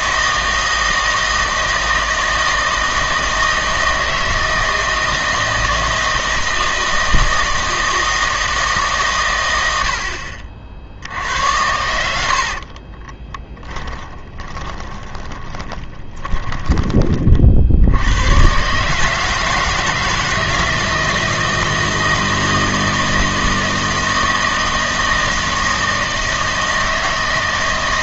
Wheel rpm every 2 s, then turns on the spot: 160, 160, 160, 160, 150, 60, 40, 20, 20, 140, 160, 160, 160, 160.
12-18